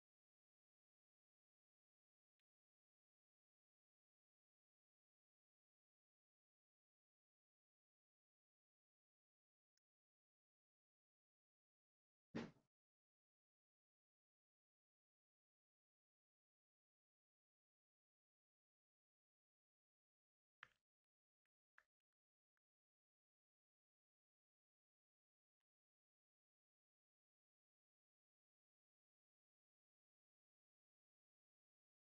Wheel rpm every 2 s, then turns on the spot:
0, 0, 0, 0, 0, 0, 0, 0, 0, 0, 0, 0, 0, 0, 0, 0.
none